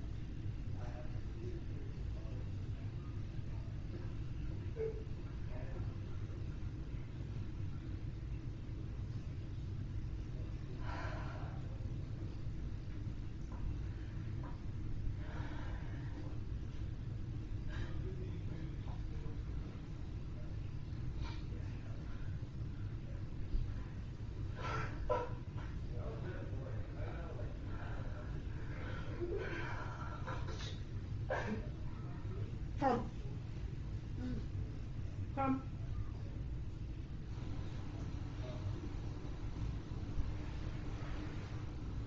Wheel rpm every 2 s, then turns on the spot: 0, 0, 0, 0, 0, 0, 0, 0, 0, 0, 0, 0, 0, 0, 0, 0, 0, 0, 0, 0, 0.
none